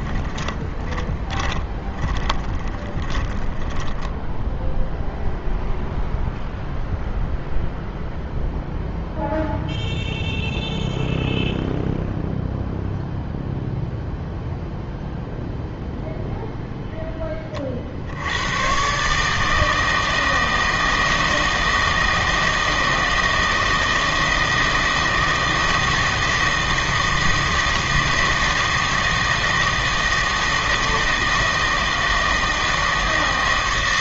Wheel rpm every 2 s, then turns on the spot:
20, 20, 0, 0, 0, 0, 0, 0, 0, 120, 160, 160, 160, 160, 160, 160, 160.
0-4